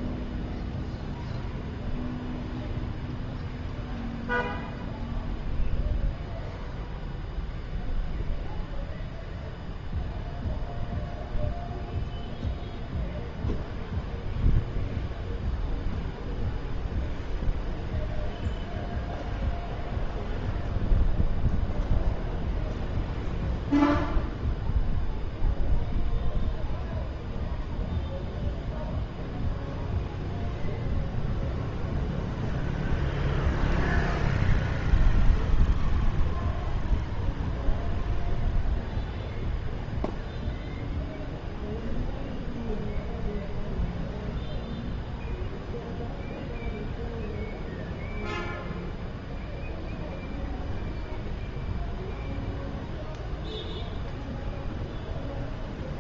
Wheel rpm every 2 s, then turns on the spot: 0, 0, 0, 0, 0, 0, 0, 0, 0, 0, 0, 0, 0, 0, 0, 0, 0, 0, 0, 0, 0, 0, 0, 0, 0, 0, 0, 0.
none